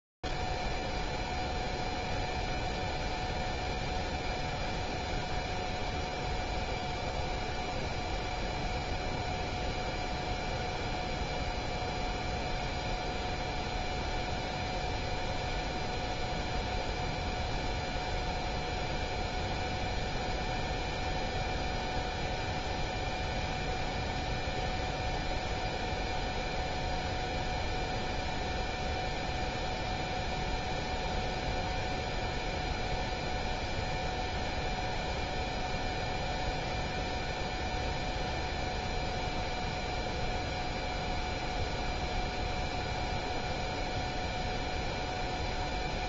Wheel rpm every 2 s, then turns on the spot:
0, 0, 0, 0, 0, 0, 0, 0, 0, 0, 0, 0, 0, 0, 0, 0, 0, 0, 0, 0, 0, 0, 0.
none